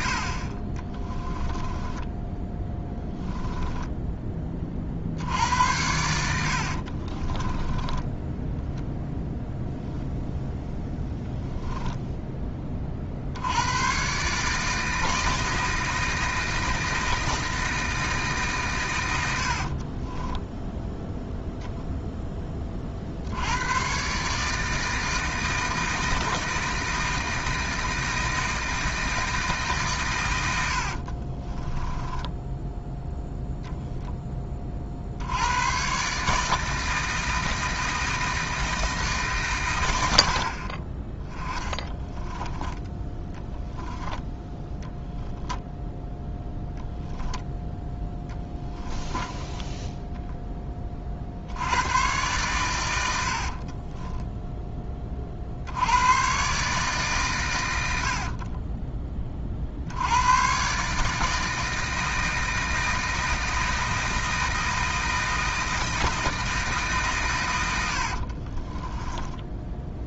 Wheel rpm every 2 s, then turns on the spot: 30, 10, 40, 50, 0, 10, 40, 160, 160, 120, 0, 40, 160, 160, 160, 70, 0, 50, 160, 160, 30, 10, 10, 0, 10, 20, 110, 20, 140, 20, 140, 160, 160, 150, 20.
0-4 6-8 10-12 30-32 42-44 48-50 68-70